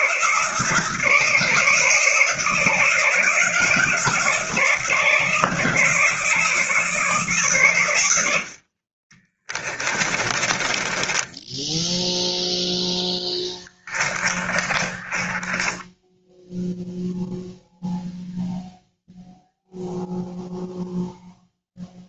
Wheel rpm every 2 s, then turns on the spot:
160, 160, 160, 160, 40, 10, 10, 20, 0, 0, 0.
10-12 14-16